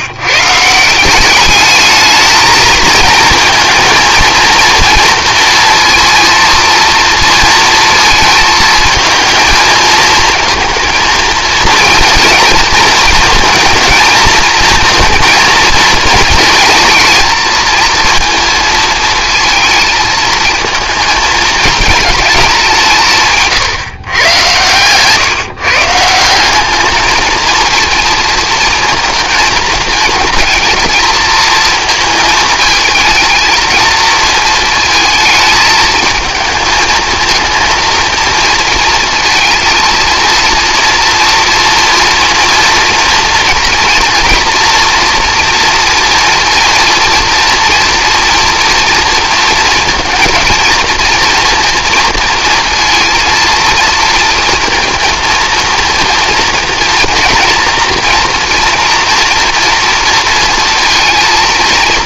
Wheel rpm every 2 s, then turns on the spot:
160, 220, 230, 230, 220, 230, 230, 230, 220, 230, 220, 190, 120, 200, 230, 220, 220, 220, 220, 230, 230, 240, 230, 230, 230, 230, 230, 230, 230, 240, 230.
24-26